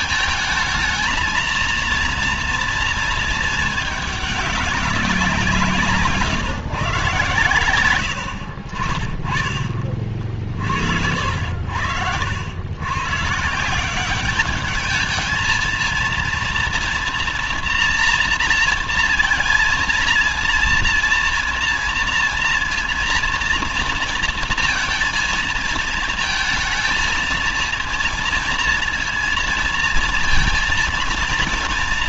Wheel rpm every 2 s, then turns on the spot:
220, 230, 200, 140, 60, 50, 90, 200, 230, 230, 230, 230, 230, 220, 230, 230.
none